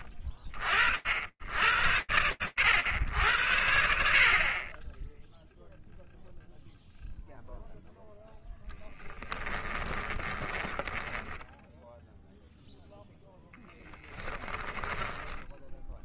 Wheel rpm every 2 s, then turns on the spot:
90, 100, 50, 0, 10, 10, 0, 10.
10-12 14-16